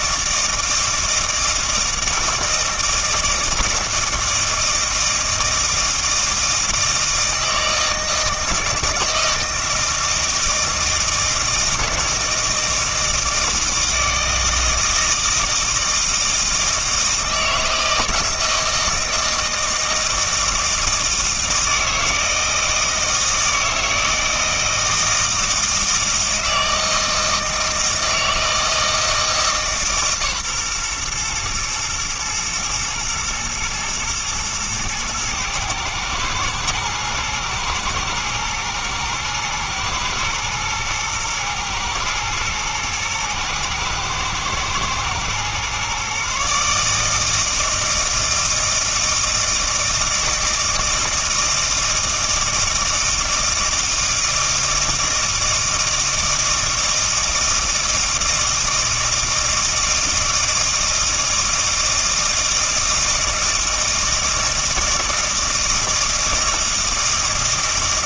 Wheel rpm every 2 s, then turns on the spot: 160, 160, 160, 160, 160, 160, 160, 160, 160, 160, 160, 160, 160, 160, 160, 140, 120, 120, 110, 110, 110, 120, 110, 140, 160, 160, 160, 160, 160, 160, 160, 160, 160, 160.
none